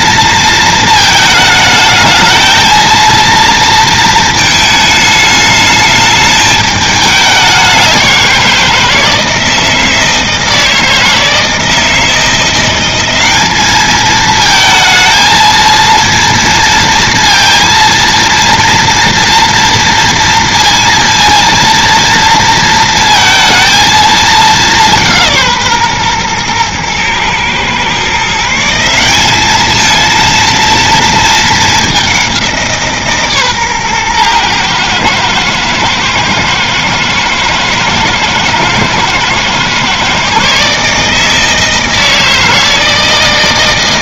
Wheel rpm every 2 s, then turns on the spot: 230, 220, 220, 210, 170, 160, 180, 220, 230, 230, 230, 230, 200, 120, 160, 230, 170, 120, 110, 110, 140, 160.
none